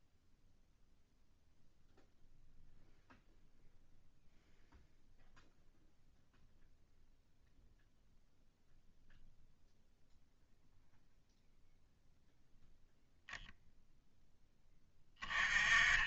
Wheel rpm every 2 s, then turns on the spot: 0, 0, 0, 0, 0, 0, 0, 20.
none